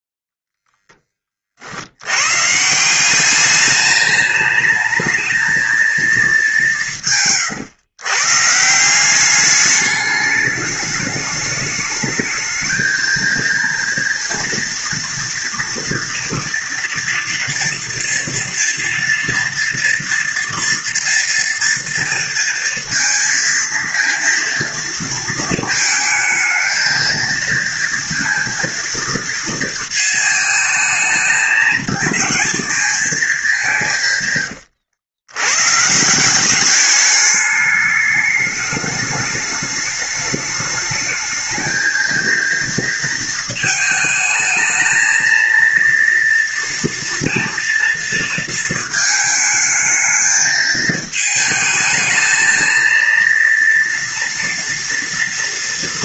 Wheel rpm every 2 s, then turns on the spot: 0, 140, 210, 200, 150, 210, 220, 230, 230, 230, 230, 230, 230, 220, 230, 220, 220, 110, 190, 210, 210, 230, 220, 230, 230, 220, 220, 240.
34-36